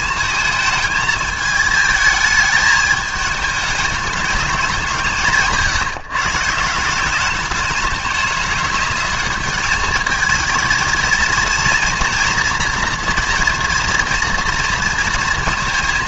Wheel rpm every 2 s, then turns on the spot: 220, 210, 180, 170, 210, 220, 240, 230.
none